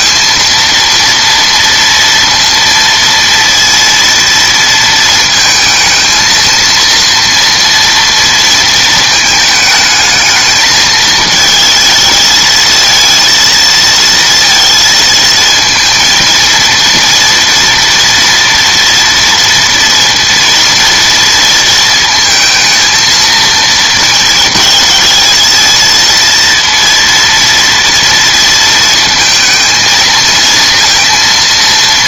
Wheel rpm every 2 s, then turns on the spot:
230, 230, 230, 230, 230, 220, 220, 230, 230, 240, 230, 230, 220, 230, 230, 230.
none